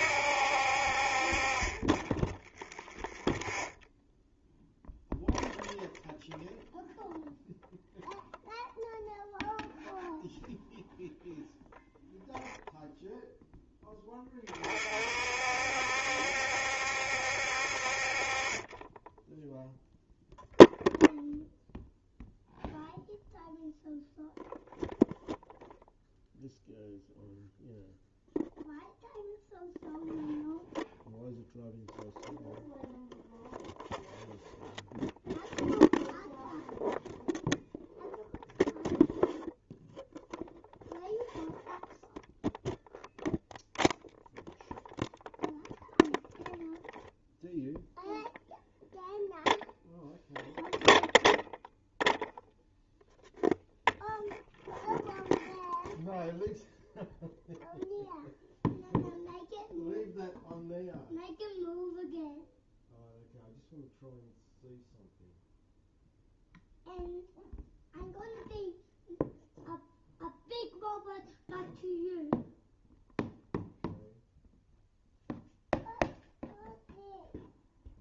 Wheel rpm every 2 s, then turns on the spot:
50, 10, 0, 0, 0, 0, 0, 40, 70, 20, 0, 0, 0, 0, 0, 0, 0, 0, 0, 0, 0, 0, 0, 0, 0, 0, 0, 0, 0, 0, 0, 0, 0, 0, 0, 0, 0, 0, 0.
2-4